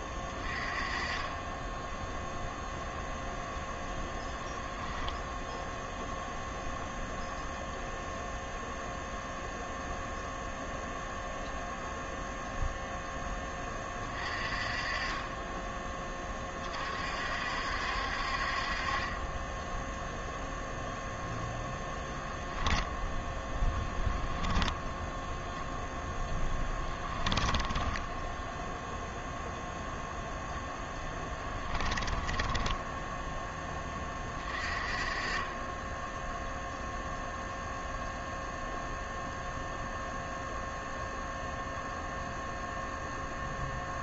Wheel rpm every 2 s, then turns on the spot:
20, 0, 0, 0, 0, 0, 0, 30, 40, 30, 0, 0, 10, 10, 0, 0, 10, 30, 0, 0, 0, 0.
24-28 32-34